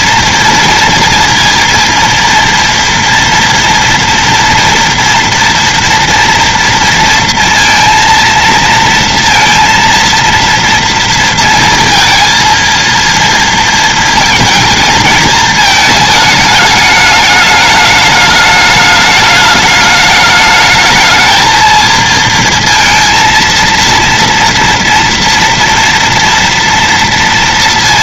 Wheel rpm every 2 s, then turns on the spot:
240, 230, 230, 230, 230, 230, 230, 230, 210, 210, 220, 230, 230, 230.
none